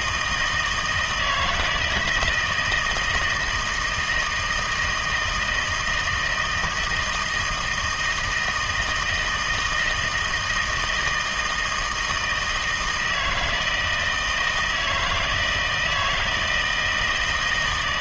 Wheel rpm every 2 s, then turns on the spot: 170, 160, 160, 160, 160, 160, 160, 160, 160.
none